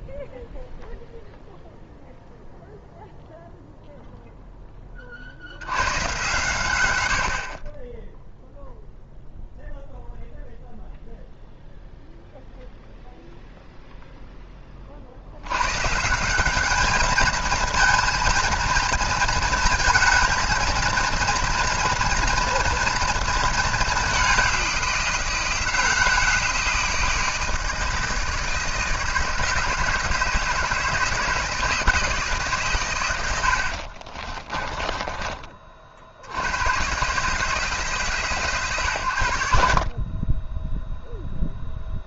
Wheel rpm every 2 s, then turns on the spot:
0, 0, 20, 100, 0, 0, 0, 50, 210, 230, 230, 230, 180, 170, 160, 160, 120, 20, 110, 110, 0.
34-36